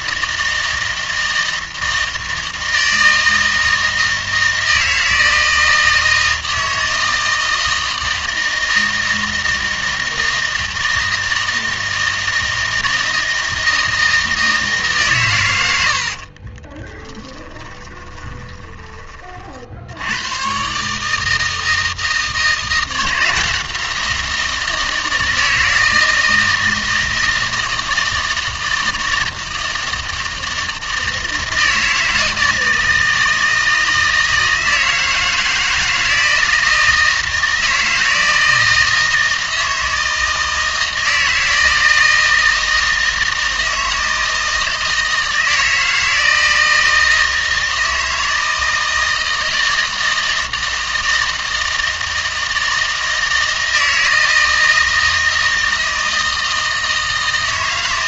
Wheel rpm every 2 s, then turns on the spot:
160, 160, 160, 160, 160, 160, 160, 150, 20, 20, 130, 160, 170, 160, 160, 160, 160, 160, 160, 160, 160, 160, 160, 160, 160, 160, 160, 160, 160.
16-20